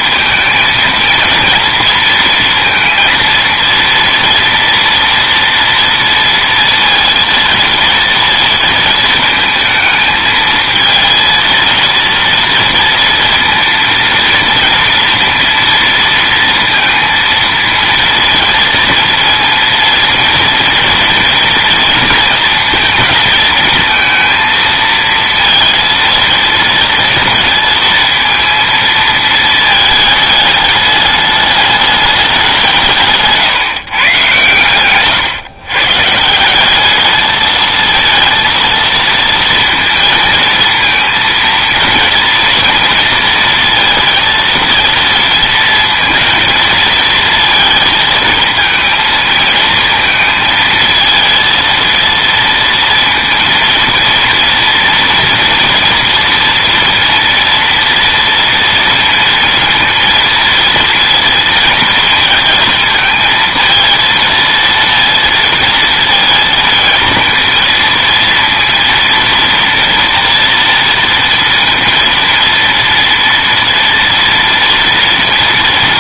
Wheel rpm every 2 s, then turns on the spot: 220, 230, 230, 230, 230, 230, 230, 230, 230, 230, 230, 230, 230, 230, 230, 210, 180, 130, 190, 230, 230, 230, 230, 230, 230, 220, 230, 230, 230, 230, 230, 230, 230, 230, 230, 230, 230, 230.
none